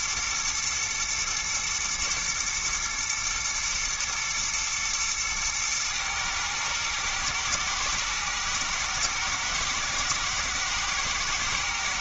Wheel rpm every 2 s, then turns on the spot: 120, 110, 110, 110, 120, 110.
none